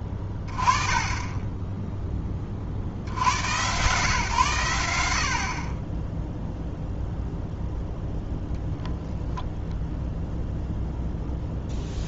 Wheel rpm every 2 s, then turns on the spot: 20, 40, 100, 0, 0, 0.
none